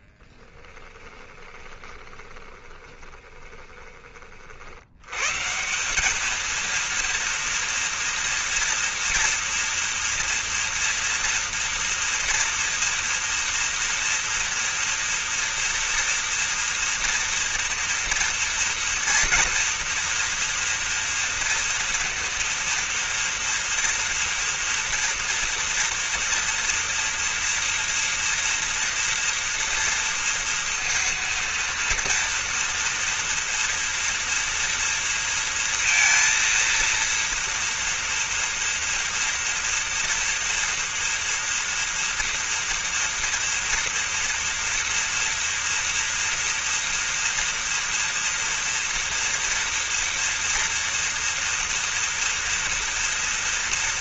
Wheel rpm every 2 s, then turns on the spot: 10, 20, 110, 230, 230, 230, 230, 230, 230, 240, 240, 230, 230, 240, 230, 230, 230, 230, 230, 230, 230, 230, 230, 230, 230, 230, 230.
0-4